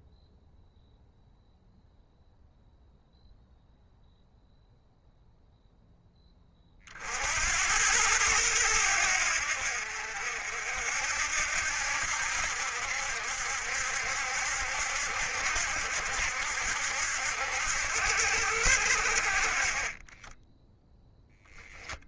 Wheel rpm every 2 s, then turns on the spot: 0, 0, 0, 40, 90, 70, 70, 70, 70, 70, 0.
none